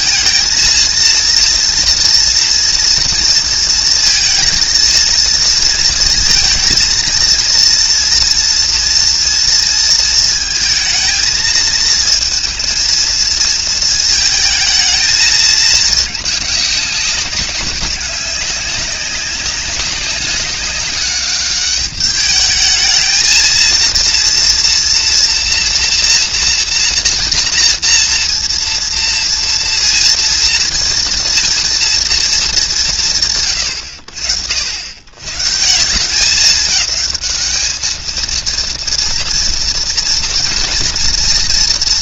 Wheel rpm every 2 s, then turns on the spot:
230, 230, 220, 230, 230, 220, 230, 220, 200, 200, 200, 220, 240, 240, 230, 230, 190, 80, 210, 230, 240.
none